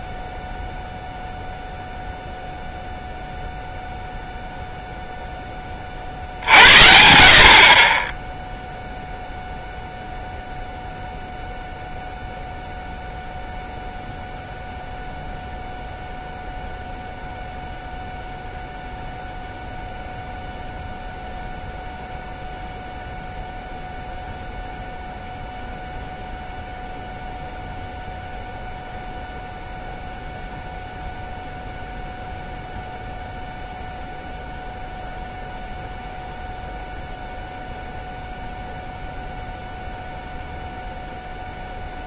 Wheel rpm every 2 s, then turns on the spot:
0, 0, 0, 70, 0, 0, 0, 0, 0, 0, 0, 0, 0, 0, 0, 0, 0, 0, 0, 0, 0.
none